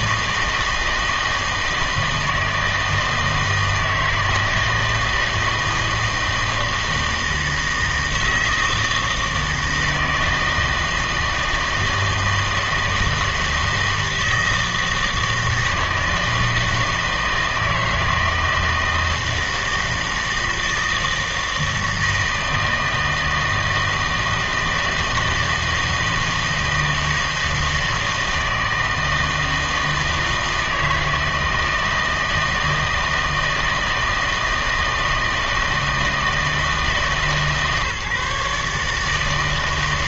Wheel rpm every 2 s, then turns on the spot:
160, 160, 160, 160, 160, 160, 160, 160, 160, 160, 160, 160, 160, 160, 160, 160, 160, 160, 160, 140.
none